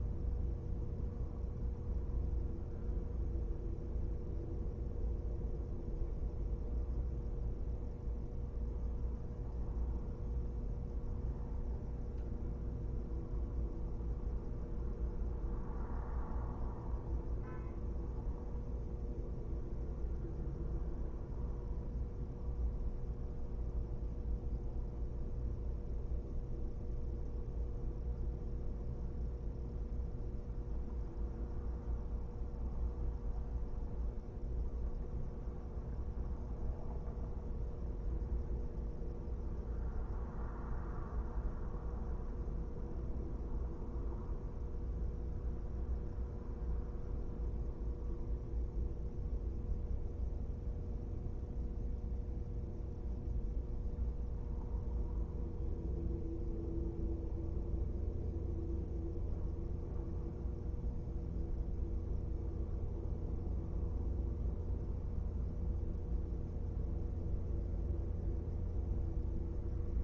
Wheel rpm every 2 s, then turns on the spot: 0, 0, 0, 0, 0, 0, 0, 0, 0, 0, 0, 0, 0, 0, 0, 0, 0, 0, 0, 0, 0, 0, 0, 0, 0, 0, 0, 0, 0, 0, 0, 0, 0, 0, 0.
none